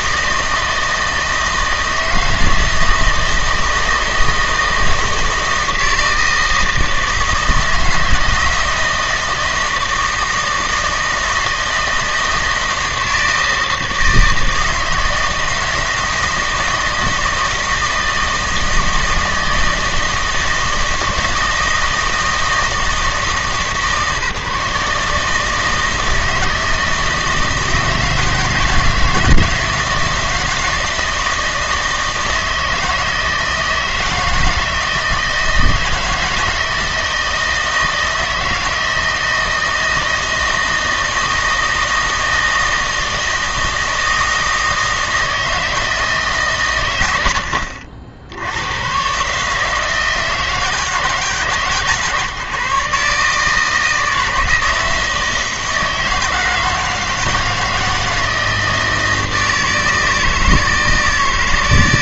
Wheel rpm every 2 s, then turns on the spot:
160, 160, 160, 160, 160, 160, 160, 160, 160, 160, 160, 160, 150, 160, 160, 160, 160, 160, 170, 170, 160, 160, 160, 130, 90, 160, 150, 160, 160, 160, 160.
none